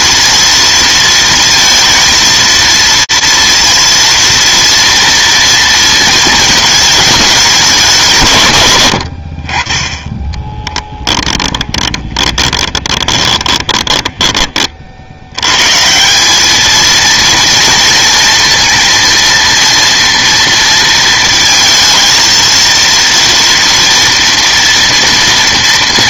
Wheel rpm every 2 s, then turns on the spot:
230, 230, 230, 230, 190, 20, 20, 20, 160, 230, 230, 220, 230.
12-16